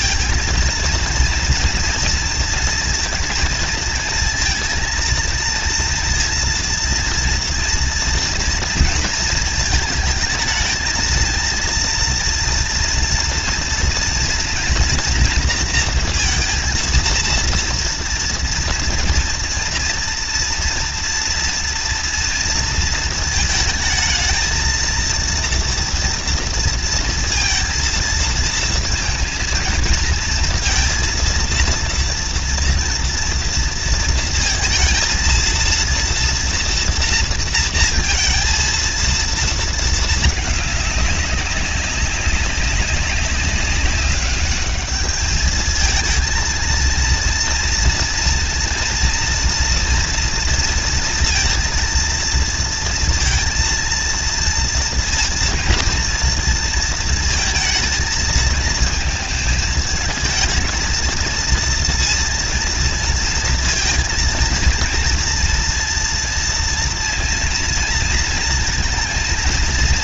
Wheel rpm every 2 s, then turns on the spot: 220, 230, 230, 230, 230, 220, 230, 230, 230, 230, 230, 240, 220, 230, 230, 230, 230, 230, 230, 230, 210, 200, 200, 220, 230, 230, 230, 230, 230, 220, 220, 230, 230, 230, 230.
none